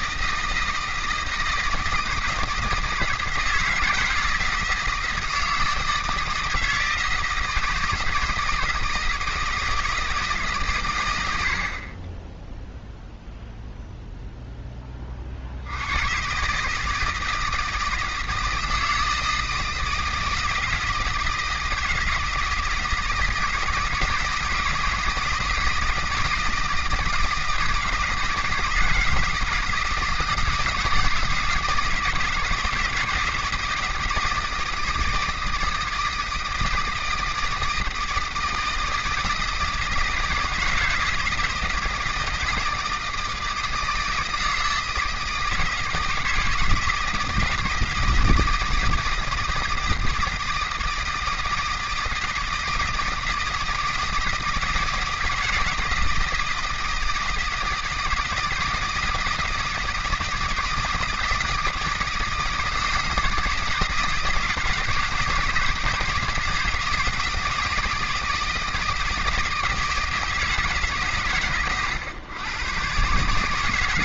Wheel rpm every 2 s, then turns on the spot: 160, 160, 160, 160, 160, 120, 0, 20, 150, 160, 160, 160, 160, 160, 160, 160, 160, 160, 160, 160, 160, 160, 160, 160, 170, 160, 160, 160, 160, 160, 170, 160, 150, 160, 160, 150, 120.
none